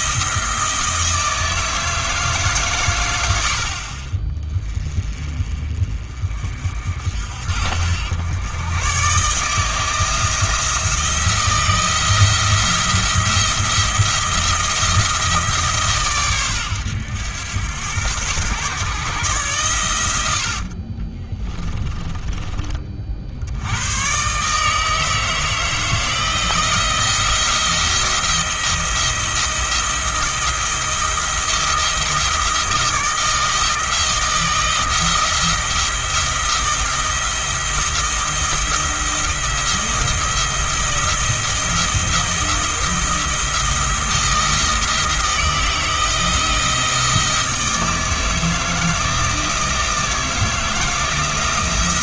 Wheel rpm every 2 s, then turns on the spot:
160, 120, 30, 60, 120, 170, 170, 170, 110, 130, 50, 40, 150, 160, 170, 170, 160, 170, 170, 170, 170, 170, 160, 170, 160, 160.
20-22